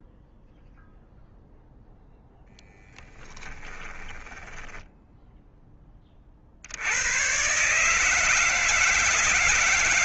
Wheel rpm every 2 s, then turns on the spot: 0, 10, 10, 60, 160.
2-6